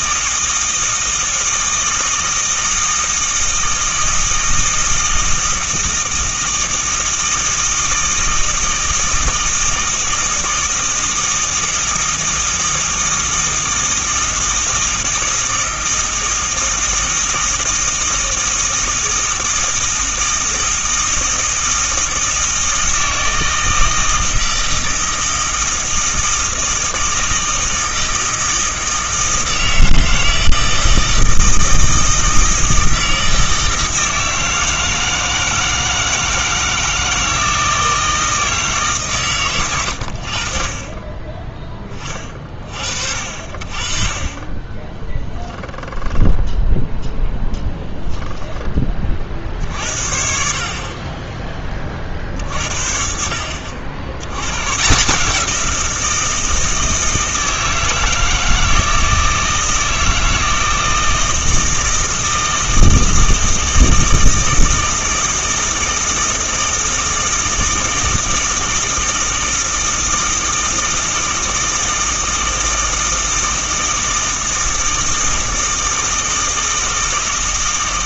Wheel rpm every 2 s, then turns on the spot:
160, 160, 160, 160, 160, 160, 160, 160, 160, 160, 160, 160, 160, 160, 160, 160, 160, 160, 160, 150, 30, 50, 20, 0, 20, 40, 50, 130, 160, 160, 160, 160, 160, 160, 160, 160, 160, 160, 160.
none